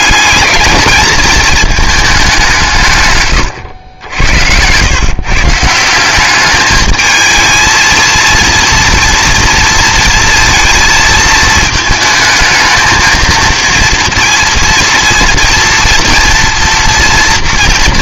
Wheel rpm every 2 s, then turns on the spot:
210, 150, 110, 220, 230, 230, 220, 230, 230.
none